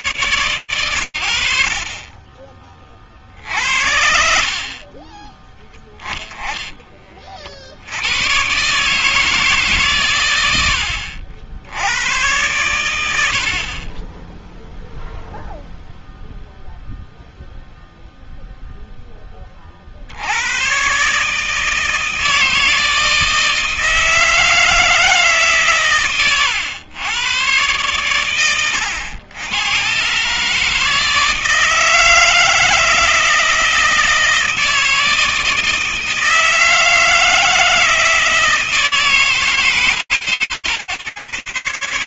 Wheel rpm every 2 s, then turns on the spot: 120, 40, 40, 20, 120, 90, 100, 10, 0, 0, 110, 160, 160, 130, 110, 150, 160, 160, 160, 160, 90.
none